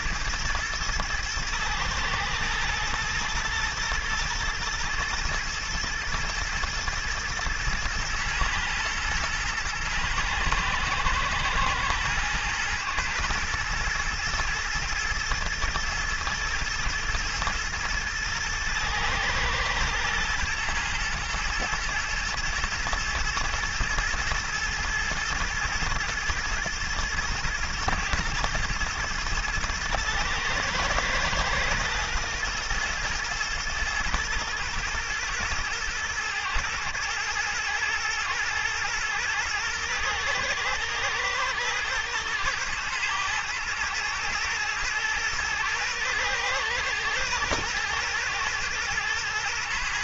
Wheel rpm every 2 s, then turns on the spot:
110, 110, 110, 120, 120, 110, 110, 120, 110, 120, 120, 110, 120, 110, 110, 120, 120, 110, 110, 110, 110, 120, 120, 120, 110.
none